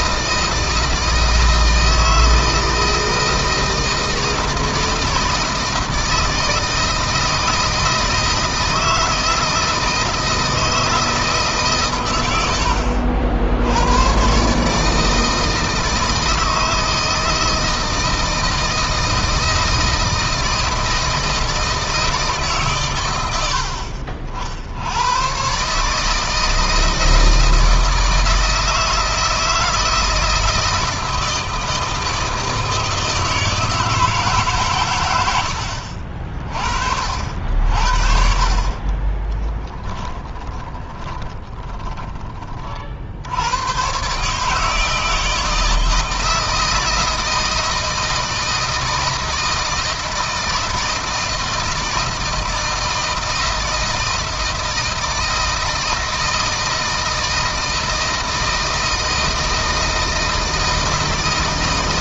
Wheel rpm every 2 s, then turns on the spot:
160, 160, 160, 160, 160, 160, 90, 150, 160, 160, 160, 120, 80, 160, 160, 160, 160, 120, 50, 30, 10, 40, 150, 160, 160, 160, 160, 160, 160, 160, 160.
38-42